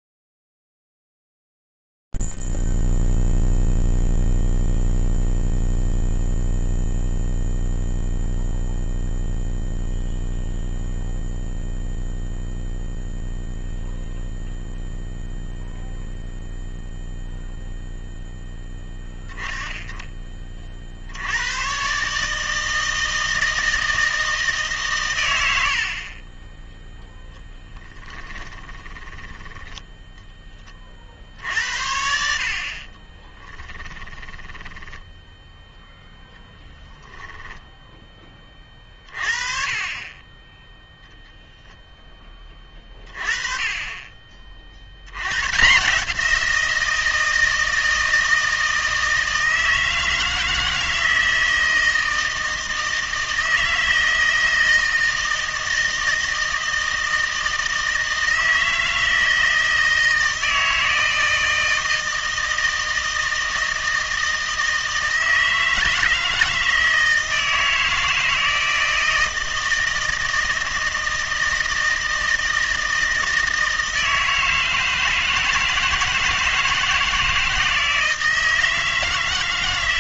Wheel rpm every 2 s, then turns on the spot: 0, 0, 0, 0, 0, 0, 0, 0, 0, 10, 40, 160, 150, 20, 30, 30, 40, 10, 0, 30, 0, 30, 60, 170, 160, 160, 160, 160, 160, 160, 160, 160, 160, 160, 160, 160, 160, 160, 160, 160.
28-30 34-36